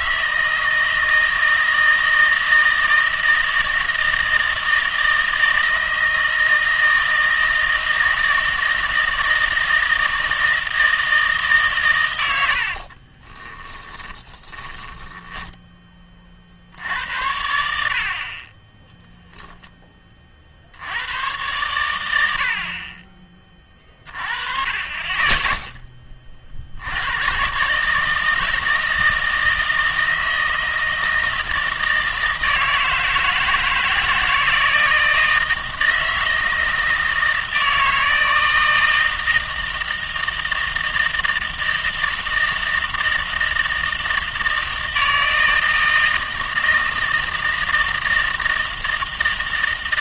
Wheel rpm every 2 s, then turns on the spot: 160, 160, 160, 160, 160, 160, 70, 30, 60, 20, 60, 60, 30, 60, 160, 160, 160, 160, 160, 160, 160, 160, 160, 160, 160.
12-16